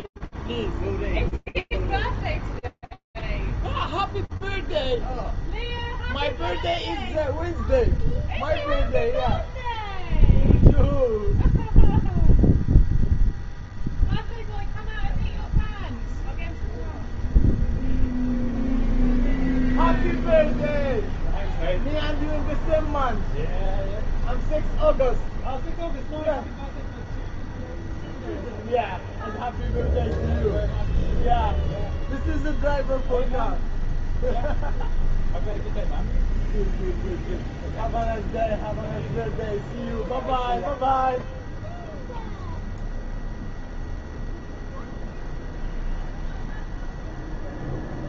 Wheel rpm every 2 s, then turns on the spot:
0, 0, 0, 0, 0, 0, 0, 0, 0, 0, 0, 0, 0, 0, 0, 0, 0, 0, 0, 0, 0, 0, 0, 10.
none